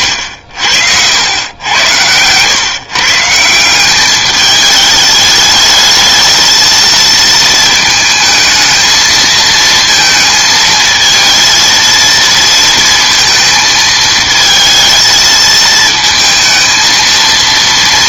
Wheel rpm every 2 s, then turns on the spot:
70, 130, 210, 230, 220, 230, 230, 220, 230.
none